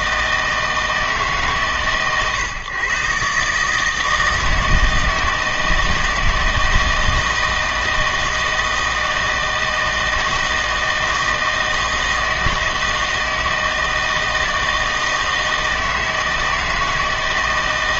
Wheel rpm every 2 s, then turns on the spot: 160, 130, 160, 160, 160, 160, 160, 160, 160.
none